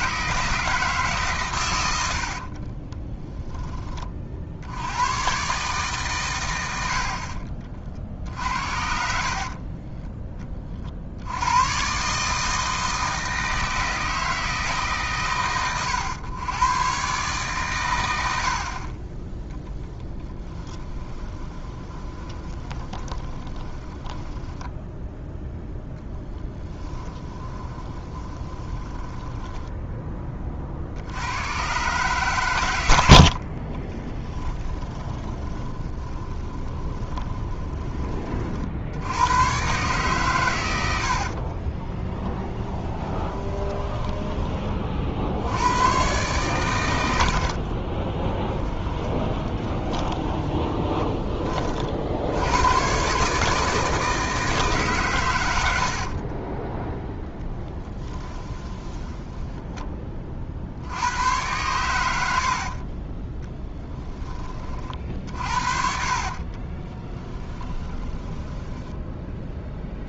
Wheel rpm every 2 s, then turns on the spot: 160, 40, 80, 80, 60, 40, 160, 140, 120, 40, 10, 20, 10, 10, 20, 60, 90, 10, 20, 60, 100, 20, 40, 100, 20, 20, 110, 150, 20, 30, 70, 30, 40, 20, 10.
2-4 8-10 20-30 34-38 42-44 48-52 56-60 62-64 66-68